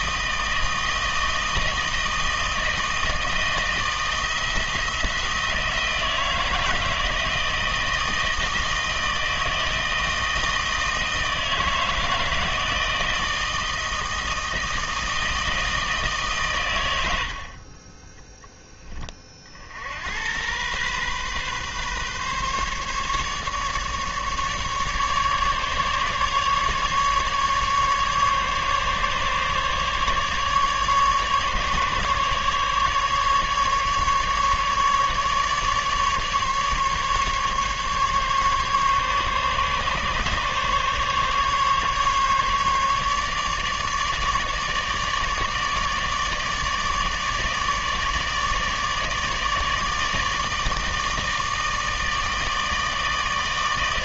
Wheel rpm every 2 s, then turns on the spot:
160, 160, 170, 160, 160, 160, 160, 160, 110, 20, 120, 140, 150, 150, 150, 150, 150, 150, 140, 140, 140, 150, 150, 150, 150, 160, 160.
none